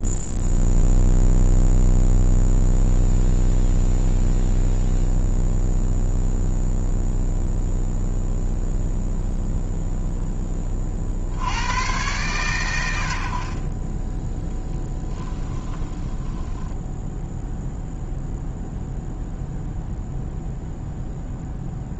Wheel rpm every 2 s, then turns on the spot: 0, 0, 0, 0, 0, 30, 110, 10, 0, 0, 0.
14-16